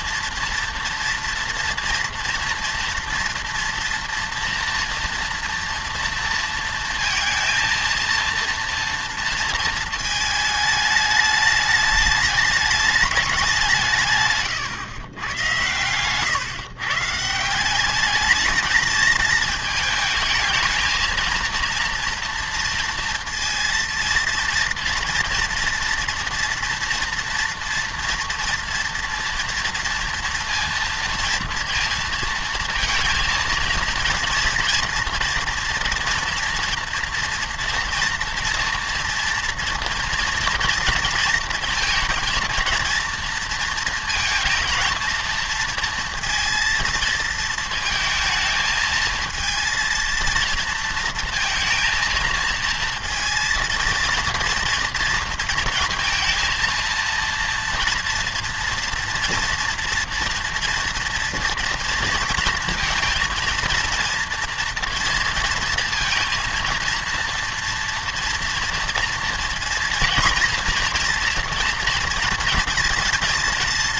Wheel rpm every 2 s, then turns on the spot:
230, 230, 230, 230, 230, 210, 210, 140, 130, 220, 220, 230, 230, 230, 230, 230, 230, 230, 230, 230, 230, 230, 230, 230, 220, 220, 230, 230, 230, 230, 230, 230, 230, 230, 240, 240, 230.
none